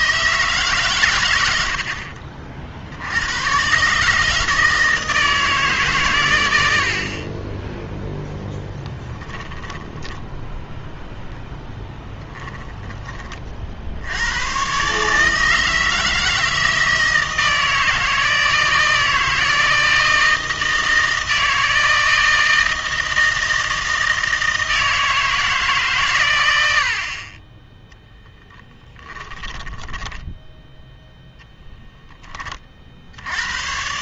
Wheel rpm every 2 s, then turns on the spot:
150, 60, 160, 80, 10, 0, 10, 120, 160, 160, 160, 160, 160, 80, 10, 0, 40.
28-30